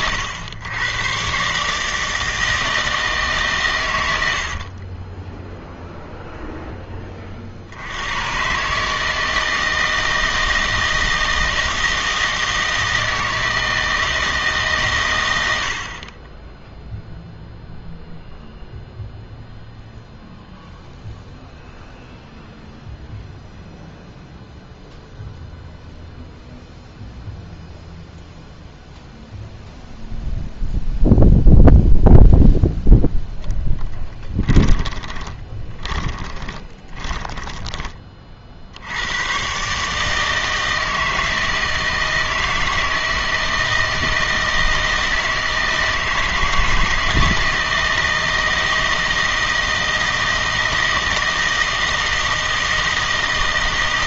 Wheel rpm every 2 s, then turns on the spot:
100, 160, 60, 0, 130, 160, 160, 150, 10, 0, 0, 0, 0, 0, 0, 0, 0, 20, 20, 60, 160, 160, 160, 160, 160, 160, 160.
34-38